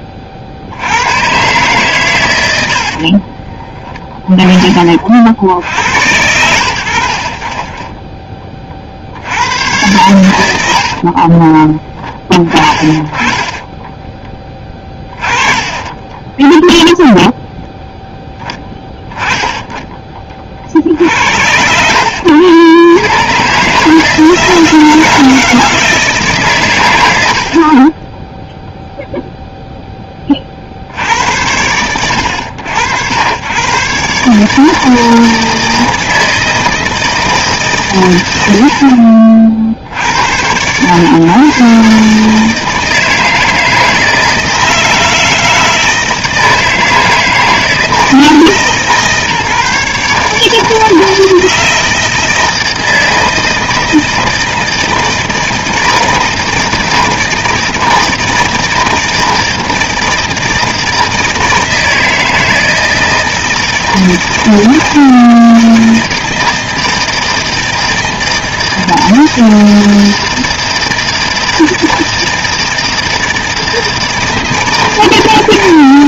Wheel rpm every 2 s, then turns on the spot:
70, 80, 20, 90, 30, 80, 40, 20, 10, 10, 50, 80, 160, 130, 0, 50, 80, 150, 160, 90, 100, 160, 160, 160, 160, 160, 160, 160, 160, 160, 160, 160, 160, 160, 160, 160, 160, 160.
2-4 14-18